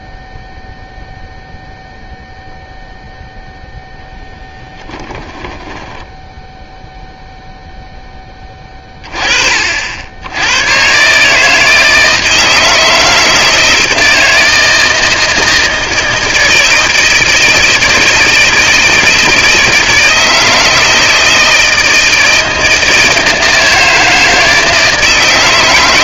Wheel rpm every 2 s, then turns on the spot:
0, 0, 0, 0, 20, 100, 160, 160, 160, 160, 160, 160, 160.
none